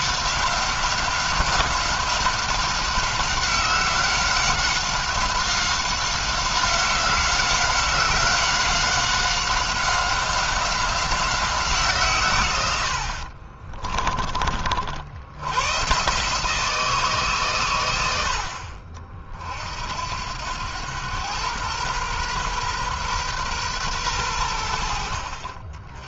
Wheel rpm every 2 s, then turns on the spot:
190, 190, 190, 190, 190, 190, 80, 60, 160, 50, 100, 130, 70.
none